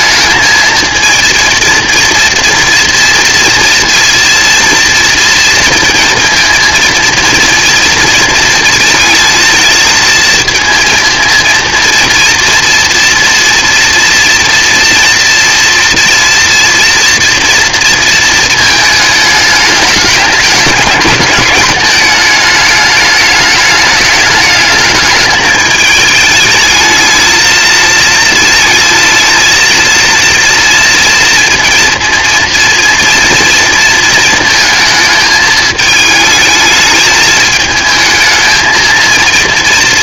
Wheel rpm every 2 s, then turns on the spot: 230, 230, 230, 230, 230, 230, 230, 230, 230, 220, 210, 210, 210, 210, 220, 230, 240, 220, 220, 220.
none